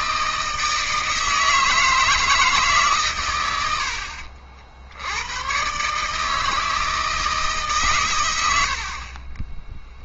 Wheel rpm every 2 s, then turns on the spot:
160, 150, 60, 160, 90.
8-10